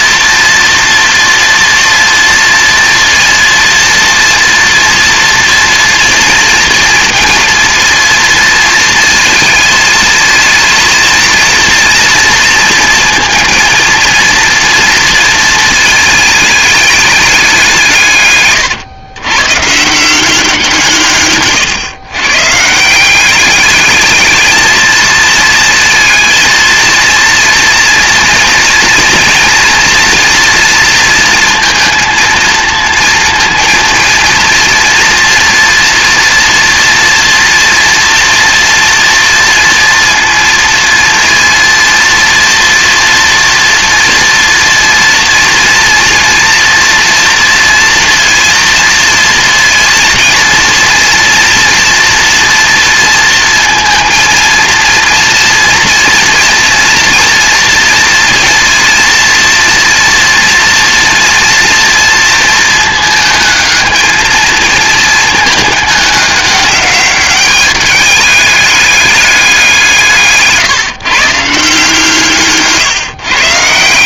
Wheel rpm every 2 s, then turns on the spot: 230, 230, 230, 240, 230, 230, 230, 230, 210, 130, 160, 170, 220, 230, 230, 230, 230, 230, 230, 230, 230, 230, 230, 230, 230, 230, 230, 230, 230, 230, 230, 220, 220, 200, 210, 140, 150.
none